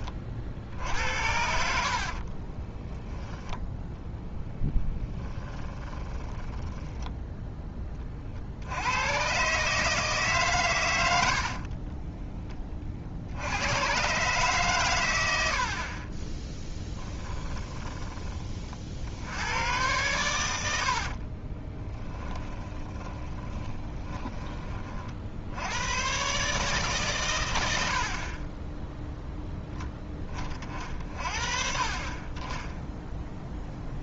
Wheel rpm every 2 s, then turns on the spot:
70, 20, 10, 20, 70, 130, 30, 130, 10, 60, 70, 20, 30, 140, 10, 40, 10.
2-4 6-8 16-18 22-24